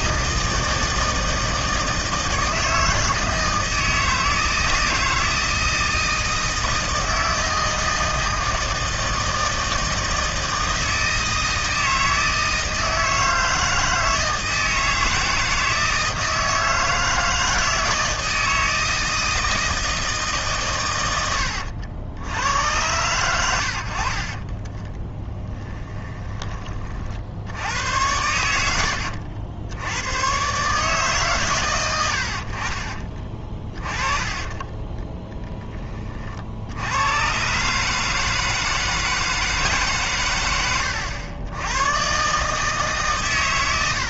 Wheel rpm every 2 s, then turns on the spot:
160, 160, 160, 160, 160, 160, 160, 160, 160, 160, 130, 100, 30, 30, 80, 140, 40, 10, 60, 160, 100, 150.
24-26